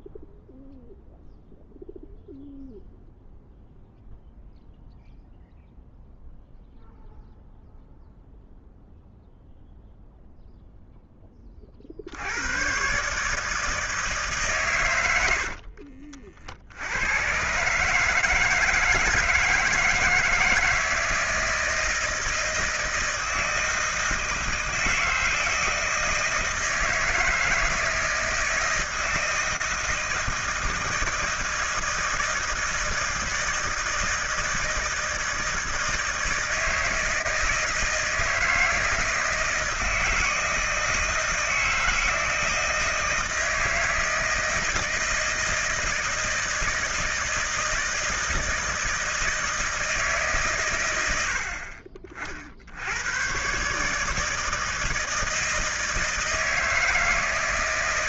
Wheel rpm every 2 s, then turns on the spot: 0, 0, 0, 0, 0, 0, 90, 140, 70, 160, 160, 160, 160, 160, 160, 160, 160, 160, 160, 160, 160, 160, 160, 160, 160, 140, 60, 160, 160.
none